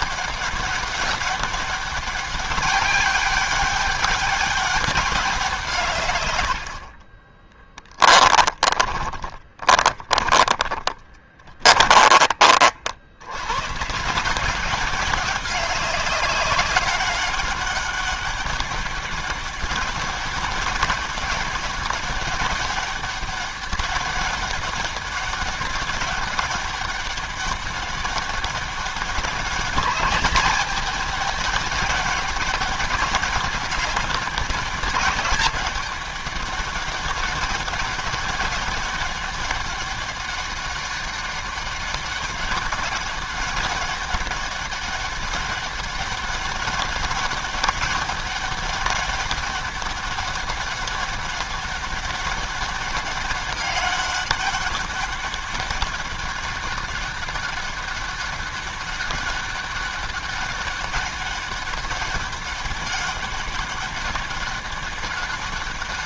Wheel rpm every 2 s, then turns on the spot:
200, 200, 200, 80, 20, 30, 40, 170, 200, 200, 190, 200, 200, 200, 200, 200, 200, 200, 200, 200, 200, 200, 200, 200, 200, 200, 200, 200, 200, 200, 200, 200, 200.
8-12